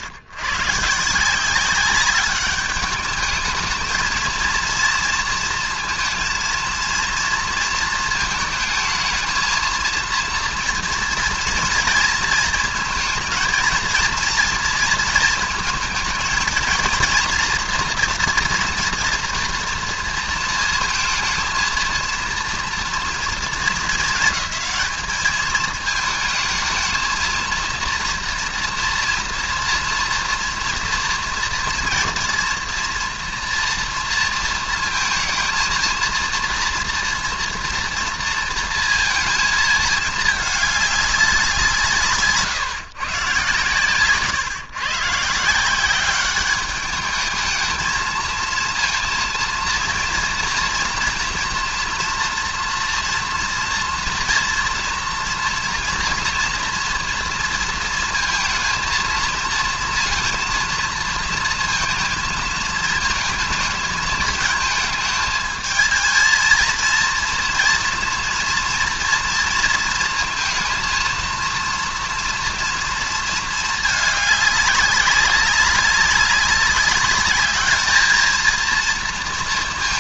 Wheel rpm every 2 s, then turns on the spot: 130, 200, 230, 230, 220, 240, 220, 230, 230, 230, 230, 230, 220, 220, 230, 230, 240, 230, 230, 230, 210, 140, 140, 200, 230, 230, 230, 230, 230, 220, 230, 220, 220, 230, 230, 230, 240, 200, 200, 230.
none